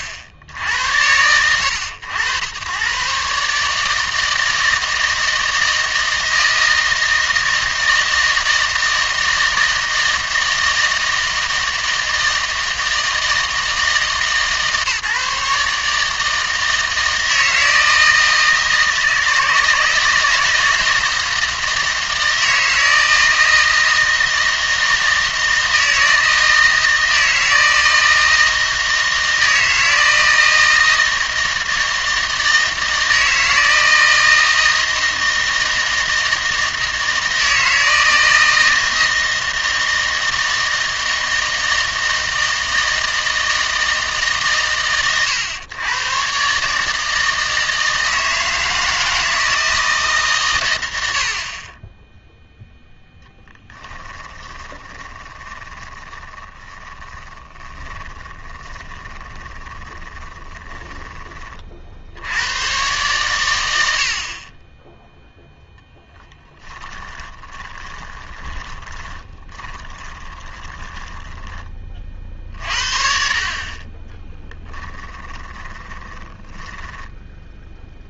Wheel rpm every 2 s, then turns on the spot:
70, 100, 160, 160, 160, 160, 160, 150, 160, 160, 160, 160, 160, 160, 160, 160, 160, 160, 160, 160, 160, 160, 130, 150, 160, 110, 0, 20, 20, 20, 20, 120, 20, 10, 20, 20, 50, 20, 10.
54-62 66-72 74-78